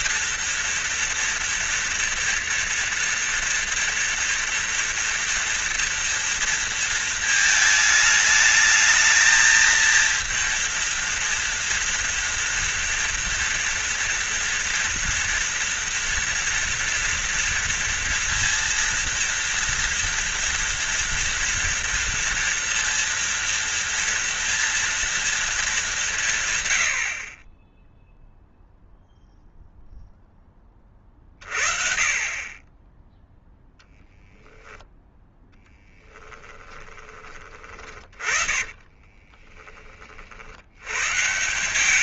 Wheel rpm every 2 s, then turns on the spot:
230, 230, 230, 230, 220, 230, 230, 230, 230, 230, 230, 230, 230, 100, 0, 20, 20, 10, 40, 30, 100.
36-40